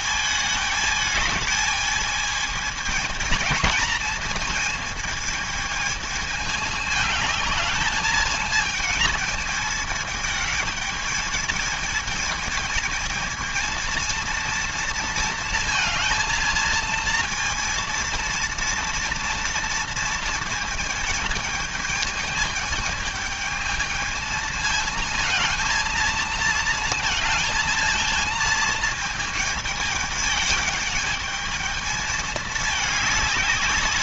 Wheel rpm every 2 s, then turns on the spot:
210, 210, 220, 210, 220, 220, 220, 230, 230, 230, 220, 220, 220, 220, 220, 220, 210.
none